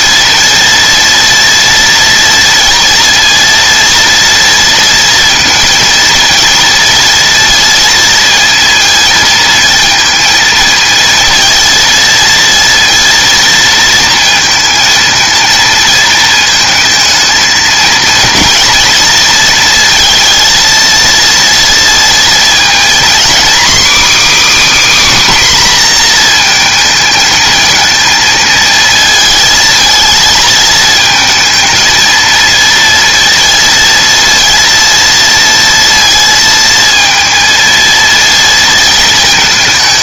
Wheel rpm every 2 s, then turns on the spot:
230, 230, 230, 230, 220, 230, 230, 230, 220, 230, 230, 230, 300, 230, 230, 220, 230, 230, 230, 230.
none